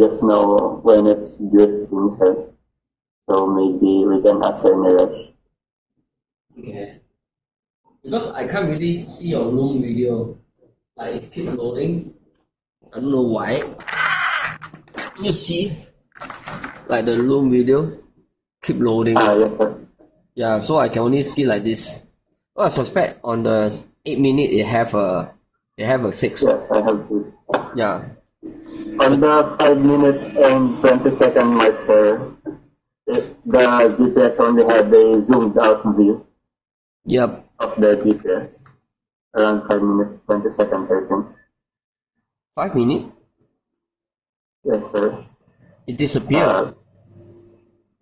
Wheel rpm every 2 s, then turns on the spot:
0, 0, 0, 0, 0, 0, 0, 0, 0, 0, 0, 0, 0, 0, 0, 0, 0, 0, 0, 0, 0, 0, 0, 0.
none